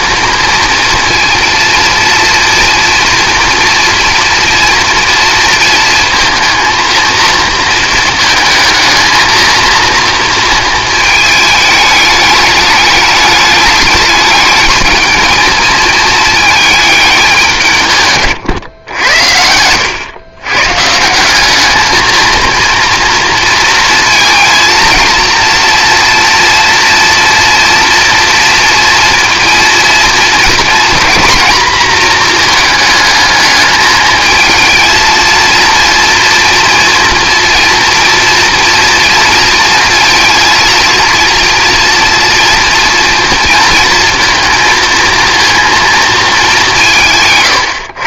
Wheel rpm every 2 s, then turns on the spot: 230, 230, 230, 230, 220, 220, 210, 220, 210, 100, 140, 230, 230, 230, 230, 230, 220, 220, 240, 230, 230, 230, 230, 170.
none